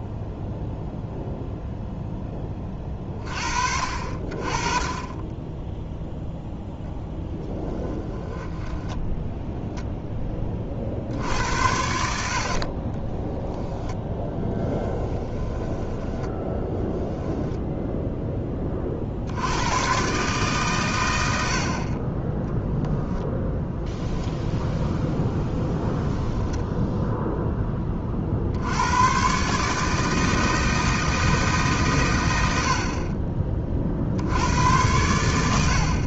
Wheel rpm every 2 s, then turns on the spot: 0, 30, 30, 0, 10, 50, 30, 10, 10, 30, 110, 10, 0, 0, 100, 160, 50, 90.
8-10 14-18 22-24